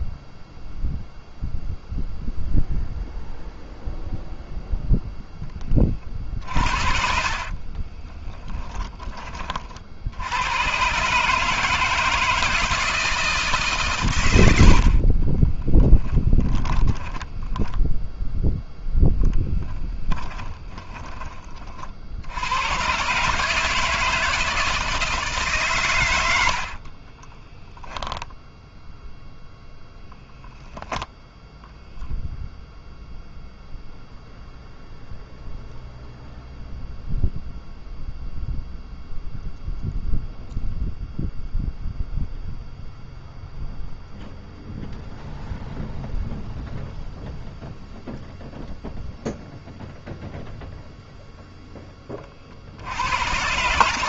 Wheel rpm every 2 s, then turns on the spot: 0, 0, 0, 40, 20, 120, 160, 60, 10, 0, 20, 110, 160, 50, 0, 0, 0, 0, 0, 0, 0, 0, 0, 0, 0, 0, 80.
6-8 14-18 20-22 26-28